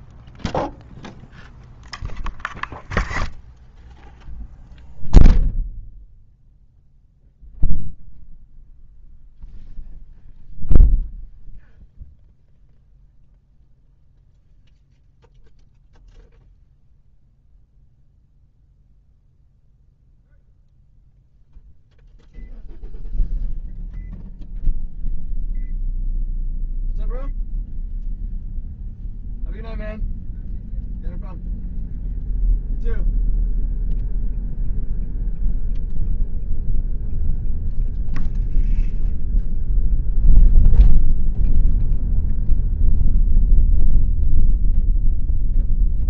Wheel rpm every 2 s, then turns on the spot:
0, 0, 0, 0, 0, 0, 0, 0, 0, 0, 0, 0, 0, 0, 0, 0, 0, 0, 0, 0, 0, 0, 0.
none